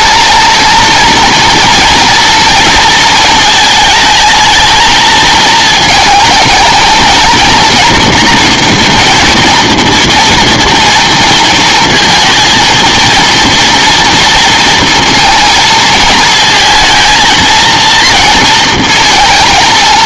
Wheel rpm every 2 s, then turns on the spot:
230, 230, 220, 230, 240, 230, 230, 230, 220, 230.
none